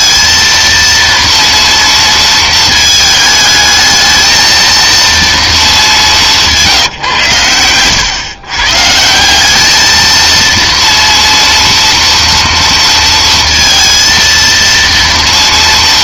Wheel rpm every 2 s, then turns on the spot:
230, 220, 230, 150, 150, 230, 230, 230.
none